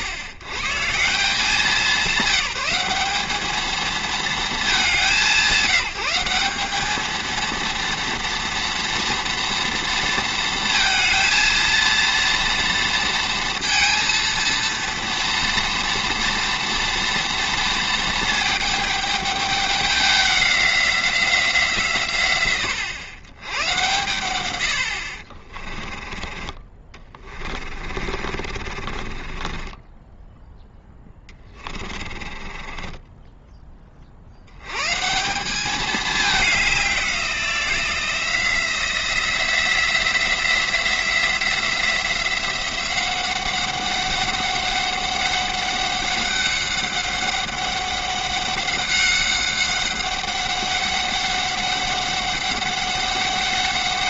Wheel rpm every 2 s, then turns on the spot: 100, 190, 190, 200, 230, 230, 230, 230, 230, 220, 190, 110, 80, 30, 40, 10, 20, 100, 200, 170, 170, 180, 200, 190, 200, 190, 190.
28-30 32-34